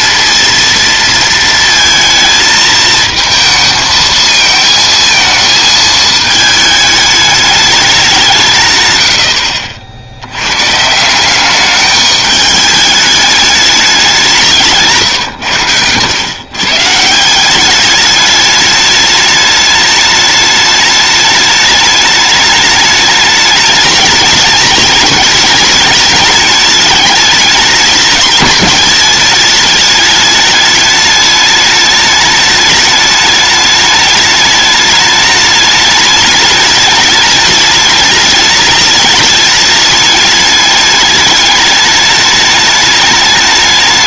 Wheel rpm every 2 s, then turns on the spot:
230, 220, 220, 220, 120, 140, 210, 160, 140, 210, 210, 210, 210, 210, 210, 210, 210, 210, 210, 210, 210, 210.
none